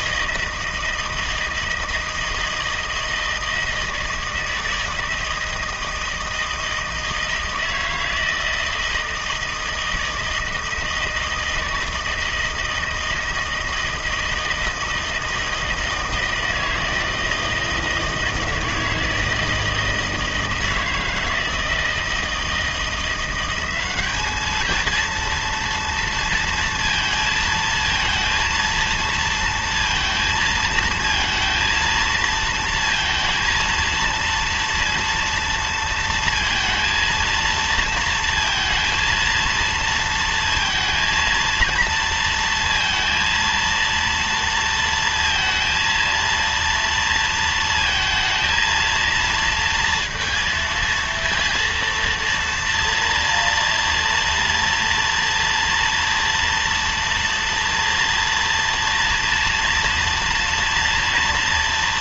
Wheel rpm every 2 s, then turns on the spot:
160, 160, 160, 160, 160, 160, 160, 160, 160, 160, 160, 170, 220, 230, 230, 220, 230, 230, 230, 230, 230, 230, 230, 230, 230, 230, 230, 230, 230, 230, 230.
none